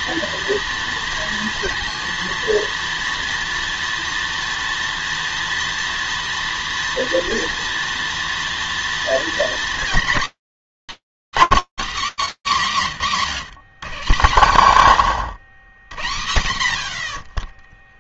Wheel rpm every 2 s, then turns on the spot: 230, 230, 230, 230, 230, 260, 160, 110, 10.
none